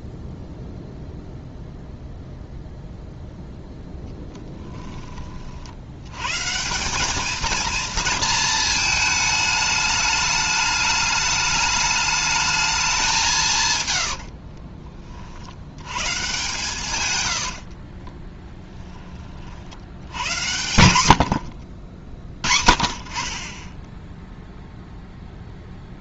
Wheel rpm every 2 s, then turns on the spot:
0, 0, 10, 150, 220, 210, 210, 50, 130, 10, 90, 40, 0.
4-6 14-16